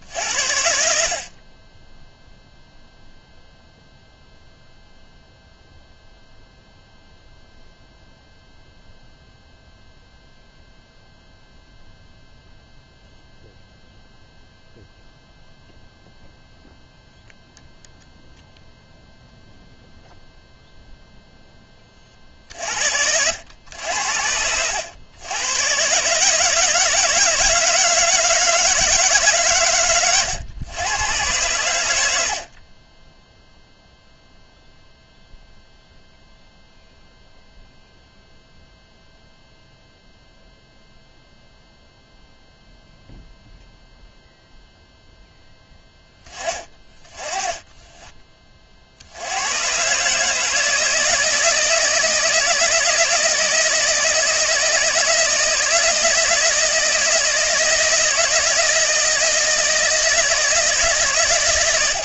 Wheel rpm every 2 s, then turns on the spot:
50, 0, 0, 0, 0, 0, 0, 0, 0, 0, 0, 60, 100, 160, 150, 110, 10, 0, 0, 0, 0, 0, 0, 20, 70, 160, 160, 160, 160, 160, 140.
0-2